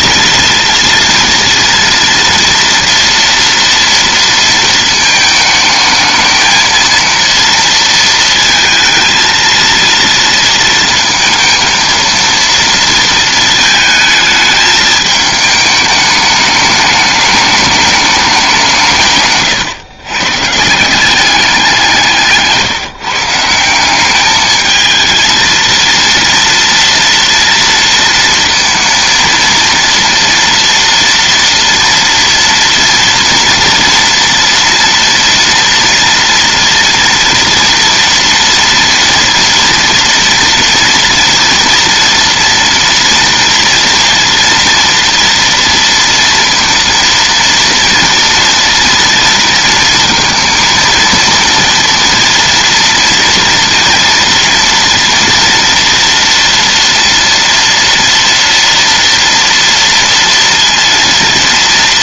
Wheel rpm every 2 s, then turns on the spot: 230, 240, 220, 230, 230, 230, 230, 210, 210, 160, 170, 160, 220, 230, 230, 230, 230, 230, 230, 230, 230, 240, 240, 230, 230, 230, 230, 230, 230, 230, 230.
none